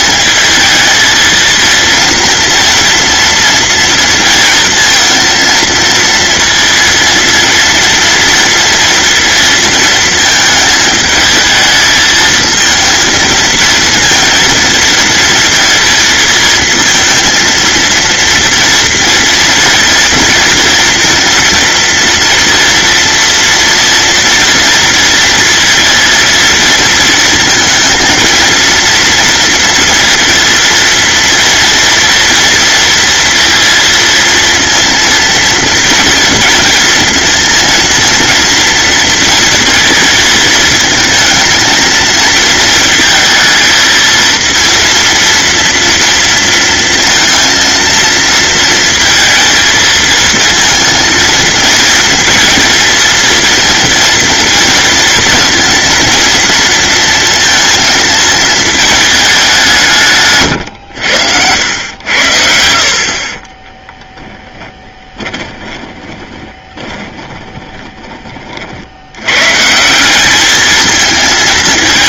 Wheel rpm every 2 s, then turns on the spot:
220, 230, 230, 230, 230, 220, 230, 230, 230, 230, 230, 230, 230, 230, 230, 230, 230, 230, 230, 230, 220, 230, 230, 230, 230, 230, 220, 230, 230, 220, 100, 70, 10, 20, 70, 220.
60-62 64-68